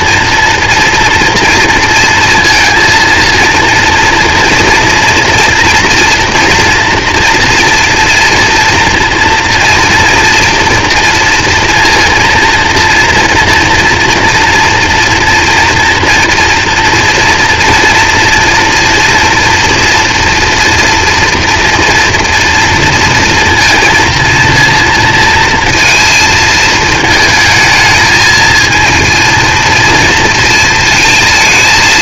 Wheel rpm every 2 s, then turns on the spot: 230, 230, 230, 230, 230, 230, 230, 230, 240, 240, 230, 230, 230, 220, 230, 230.
none